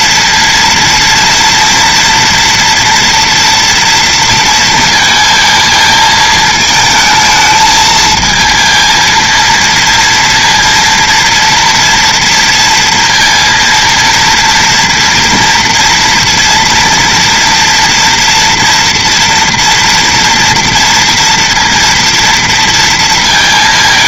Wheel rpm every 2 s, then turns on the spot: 230, 240, 230, 220, 220, 230, 230, 230, 230, 240, 230, 230.
none